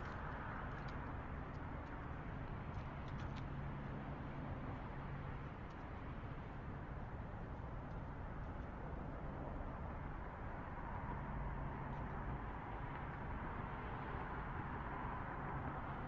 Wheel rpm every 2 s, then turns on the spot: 0, 0, 0, 0, 0, 0, 0, 0.
none